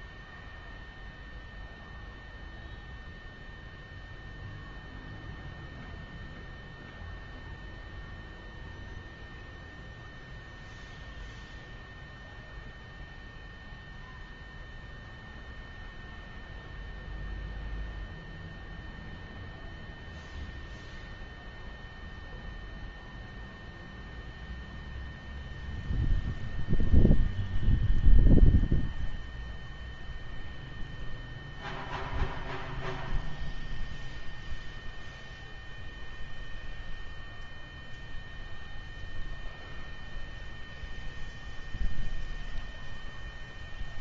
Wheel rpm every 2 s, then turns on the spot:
0, 0, 0, 0, 0, 0, 0, 0, 0, 0, 0, 0, 0, 0, 0, 0, 0, 0, 0, 0, 0, 0.
none